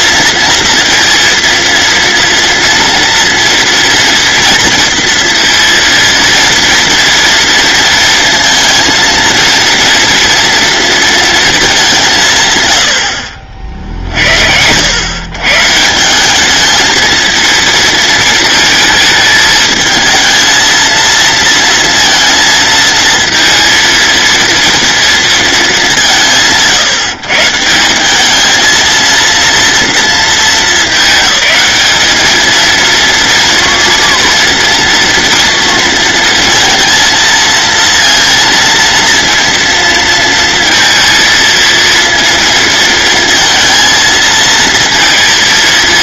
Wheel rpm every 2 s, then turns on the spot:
230, 230, 230, 230, 230, 230, 100, 90, 210, 220, 220, 230, 230, 150, 220, 210, 230, 230, 230, 230, 230, 230, 230.
none